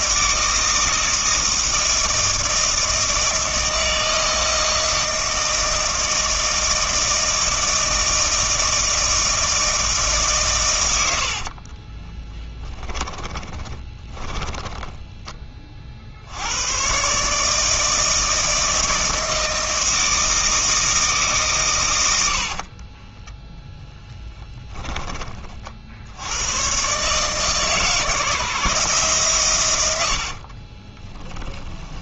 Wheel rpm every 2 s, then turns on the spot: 160, 160, 160, 160, 160, 110, 10, 10, 110, 160, 160, 40, 10, 120, 150, 30.
12-16 22-24 30-32